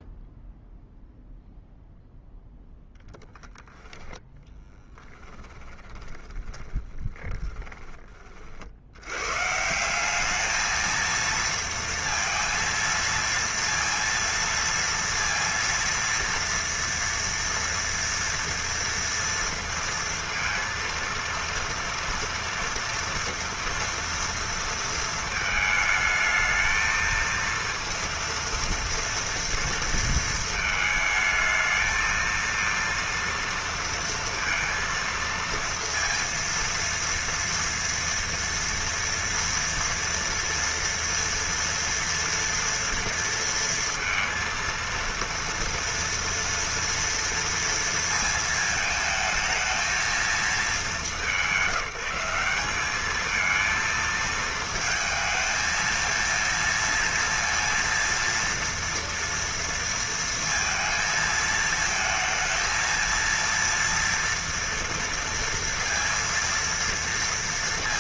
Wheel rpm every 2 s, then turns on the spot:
0, 0, 10, 20, 70, 220, 230, 230, 230, 230, 230, 230, 230, 220, 230, 220, 230, 230, 230, 230, 230, 230, 230, 230, 220, 190, 190, 220, 230, 230, 230, 220, 230, 230.
4-8